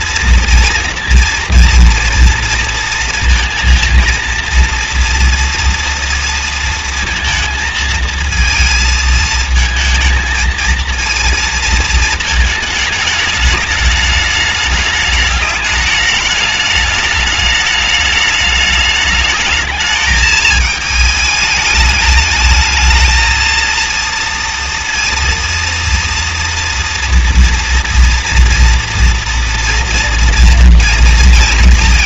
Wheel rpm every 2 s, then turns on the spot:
240, 230, 230, 230, 230, 220, 210, 210, 210, 210, 220, 220, 230, 230, 230, 230.
none